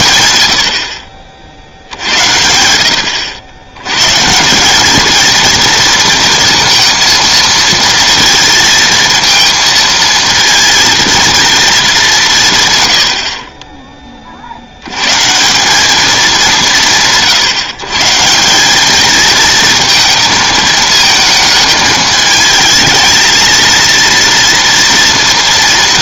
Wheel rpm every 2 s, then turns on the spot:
70, 90, 220, 230, 230, 230, 90, 130, 160, 220, 220, 220, 240.
none